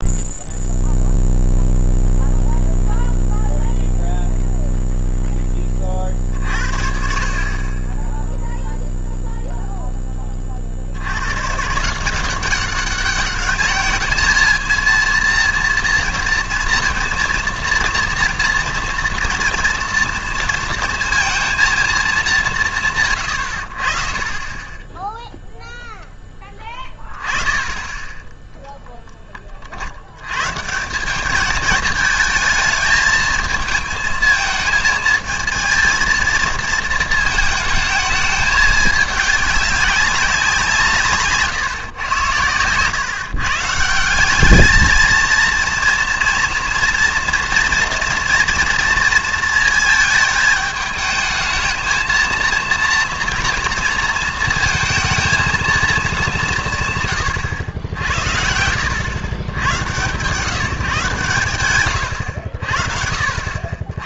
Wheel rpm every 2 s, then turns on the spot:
0, 0, 0, 60, 0, 50, 190, 230, 230, 230, 230, 160, 10, 10, 10, 160, 220, 220, 220, 210, 180, 110, 210, 230, 230, 220, 230, 230, 160, 80, 160, 70.
none